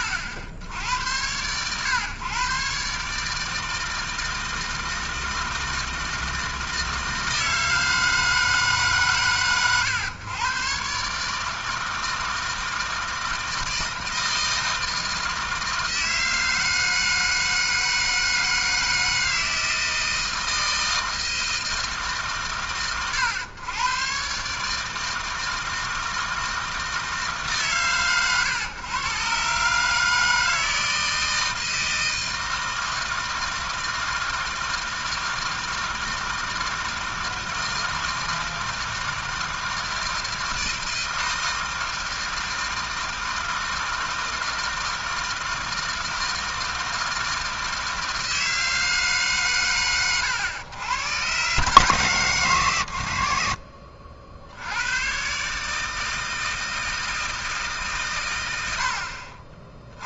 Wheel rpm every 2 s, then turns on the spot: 80, 130, 160, 160, 150, 120, 160, 160, 160, 160, 160, 100, 150, 160, 120, 160, 160, 160, 160, 160, 160, 160, 160, 160, 160, 100, 120, 90, 160, 50.
none